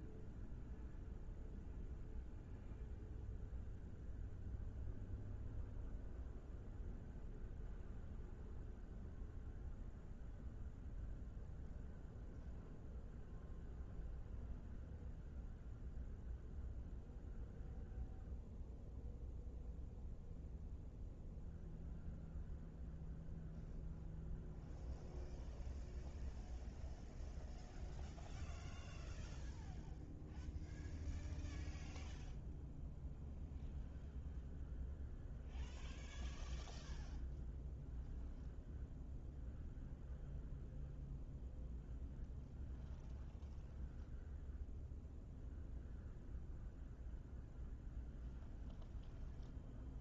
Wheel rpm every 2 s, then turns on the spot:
0, 0, 0, 0, 0, 0, 0, 0, 0, 0, 0, 0, 0, 0, 0, 0, 0, 0, 0, 0, 0, 0, 0, 0, 0.
none